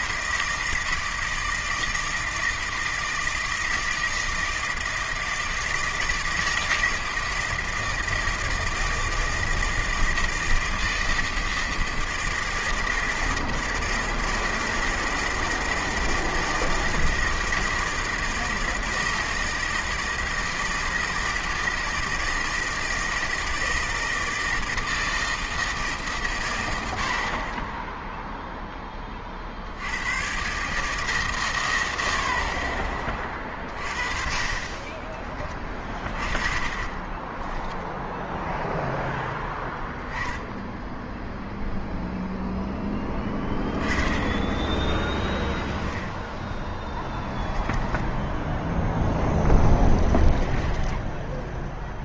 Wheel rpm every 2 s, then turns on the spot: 160, 160, 160, 160, 160, 160, 160, 160, 160, 160, 160, 160, 160, 100, 10, 140, 40, 30, 30, 0, 0, 10, 10, 10, 0, 20.
34-38 50-52